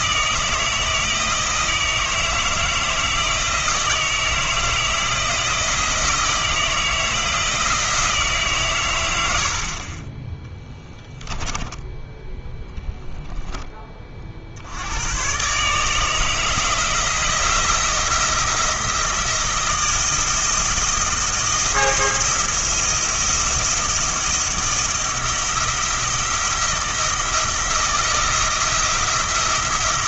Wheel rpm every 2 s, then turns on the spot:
160, 160, 170, 170, 130, 10, 0, 70, 160, 170, 170, 170, 170, 170, 170.
10-12